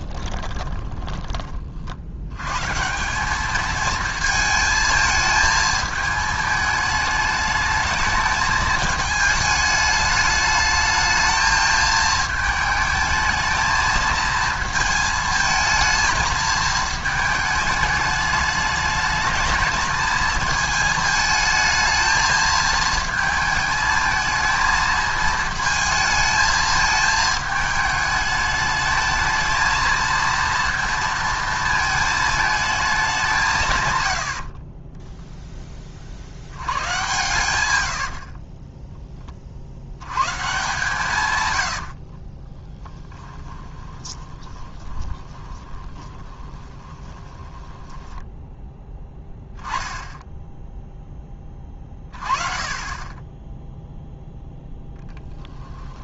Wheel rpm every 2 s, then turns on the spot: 10, 130, 220, 220, 220, 210, 220, 220, 220, 210, 220, 220, 220, 220, 220, 230, 210, 50, 90, 20, 140, 30, 20, 20, 10, 0, 40, 10.
0-2 34-36 38-40 42-48